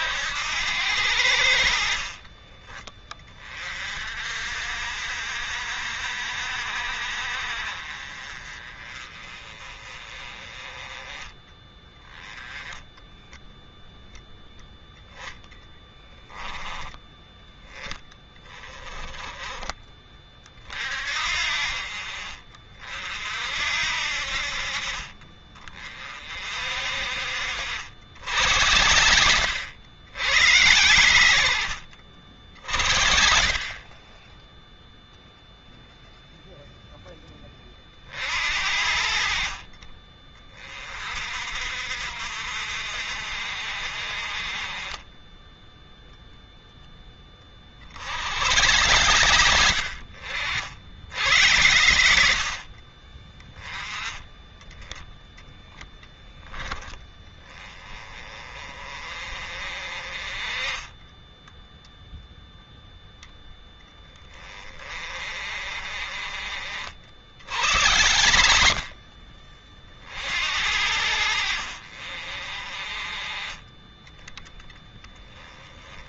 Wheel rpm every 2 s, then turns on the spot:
80, 30, 50, 60, 30, 20, 10, 0, 10, 20, 40, 60, 50, 40, 80, 90, 50, 10, 0, 50, 30, 60, 30, 10, 100, 70, 50, 10, 10, 30, 30, 0, 40, 40, 70, 50, 40, 20.
2-4 60-62